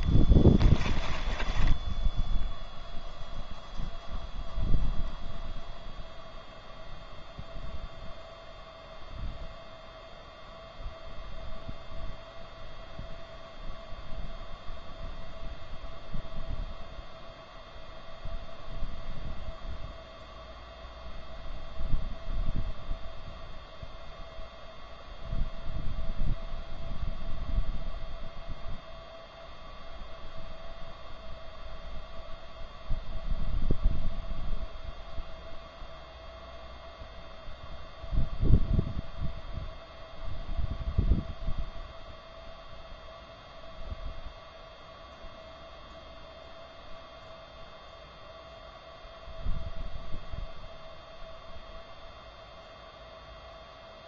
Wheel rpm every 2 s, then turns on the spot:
20, 0, 0, 0, 0, 0, 0, 0, 0, 0, 0, 0, 0, 0, 0, 0, 0, 0, 0, 0, 0, 0, 0, 0, 0, 0, 0.
0-2